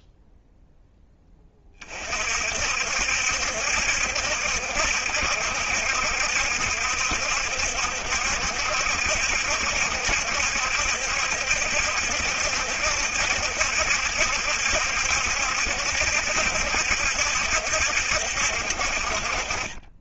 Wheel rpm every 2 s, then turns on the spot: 0, 50, 70, 70, 70, 70, 70, 70, 70, 60.
none